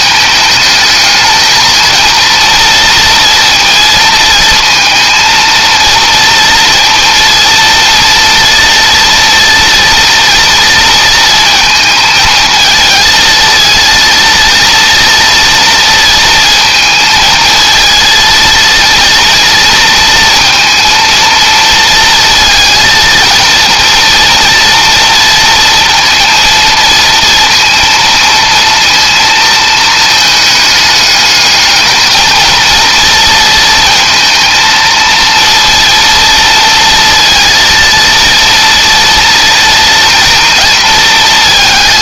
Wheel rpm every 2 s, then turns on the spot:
220, 230, 230, 230, 240, 230, 230, 230, 220, 230, 230, 230, 230, 230, 230, 210, 230, 230, 230, 240, 230.
none